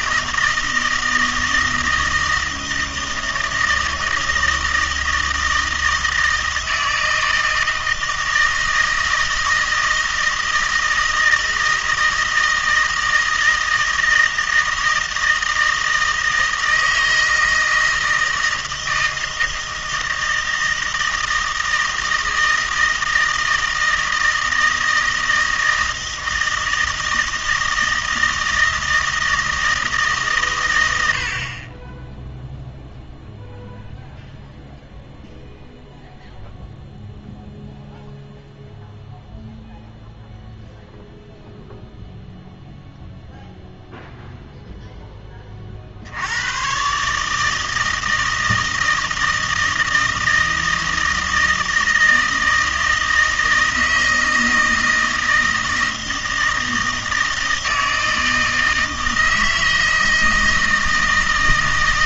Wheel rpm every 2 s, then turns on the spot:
160, 160, 160, 160, 160, 160, 160, 160, 160, 160, 160, 160, 160, 160, 160, 110, 0, 0, 0, 0, 0, 0, 0, 110, 160, 160, 160, 160, 160, 160, 160.
none